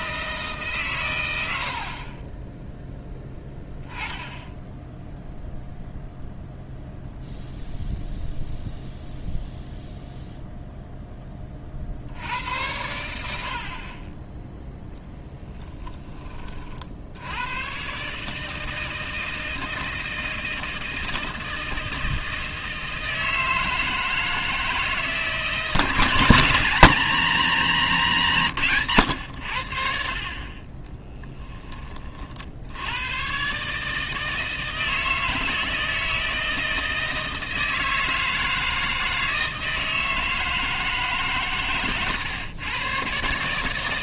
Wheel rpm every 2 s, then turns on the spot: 130, 0, 0, 0, 0, 0, 80, 20, 60, 160, 160, 160, 160, 170, 130, 20, 90, 160, 160, 160, 160, 130.
30-32